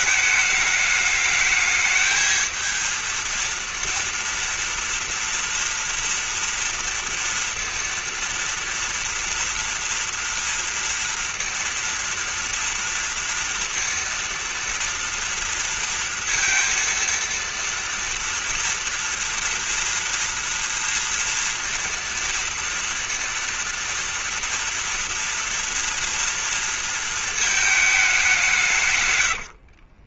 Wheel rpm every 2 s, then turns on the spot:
210, 220, 230, 230, 230, 230, 230, 230, 230, 230, 230, 230, 230, 230, 200.
none